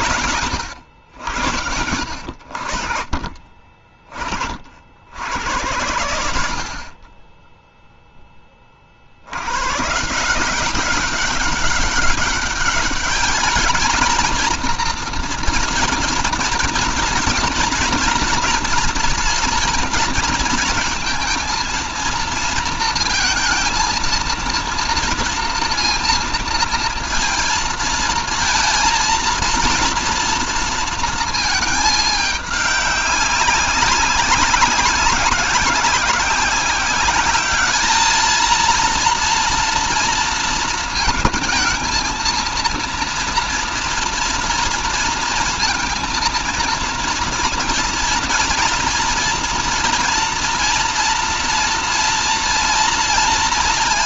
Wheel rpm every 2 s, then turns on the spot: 130, 60, 50, 60, 40, 190, 210, 230, 240, 230, 230, 230, 230, 230, 230, 230, 200, 200, 190, 230, 230, 230, 230, 230, 230, 230, 230.
none